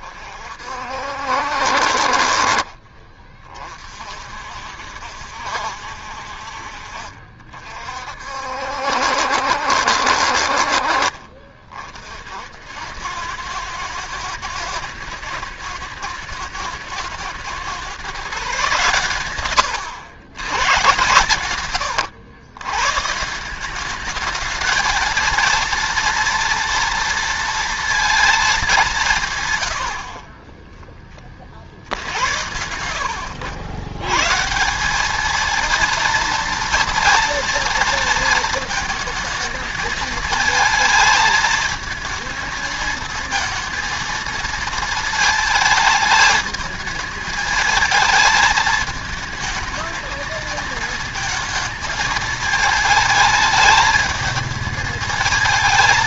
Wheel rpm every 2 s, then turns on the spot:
50, 40, 60, 50, 60, 50, 80, 120, 110, 140, 130, 120, 220, 230, 210, 20, 100, 170, 230, 220, 220, 220, 230, 220, 220, 220, 220, 220.
none